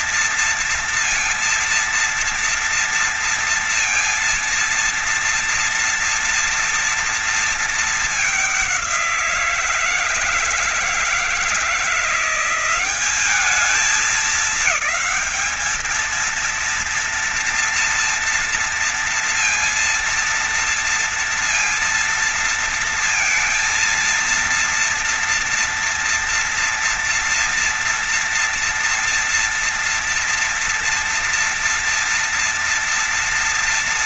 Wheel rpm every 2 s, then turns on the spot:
230, 230, 230, 230, 190, 160, 190, 210, 230, 230, 230, 230, 230, 230, 230, 230, 230.
none